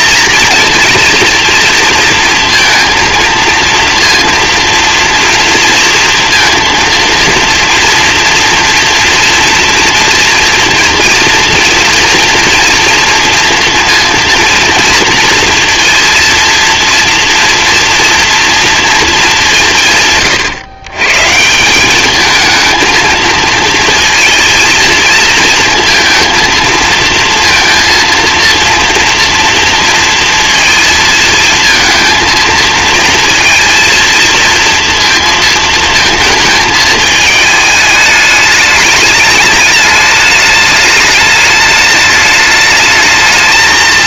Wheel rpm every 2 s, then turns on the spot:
230, 230, 230, 230, 230, 230, 230, 230, 230, 230, 130, 220, 230, 220, 230, 220, 230, 230, 220, 210, 210, 220.
none